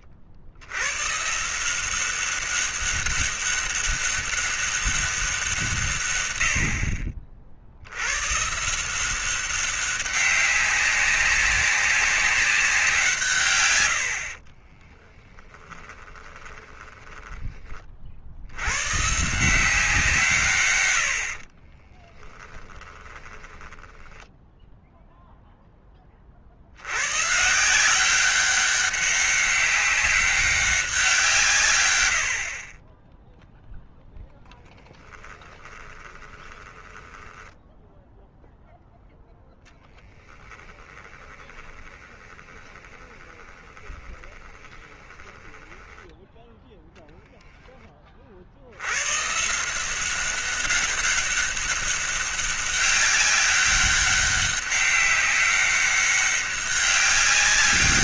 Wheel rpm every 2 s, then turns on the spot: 60, 190, 200, 60, 160, 190, 180, 30, 20, 100, 100, 10, 0, 80, 200, 190, 40, 10, 20, 0, 10, 20, 20, 10, 90, 200, 200, 200, 200.
14-18 22-24 34-38 40-46